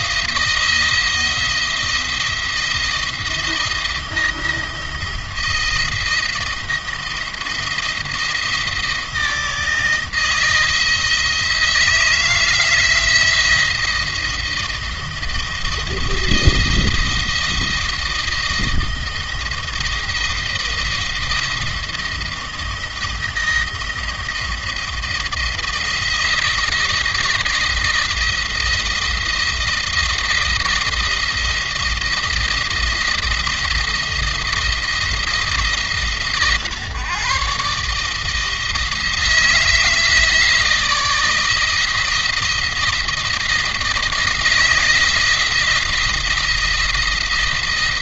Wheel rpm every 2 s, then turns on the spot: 170, 170, 170, 170, 160, 160, 170, 170, 170, 170, 170, 170, 170, 170, 170, 170, 170, 170, 140, 160, 160, 170, 170, 170.
none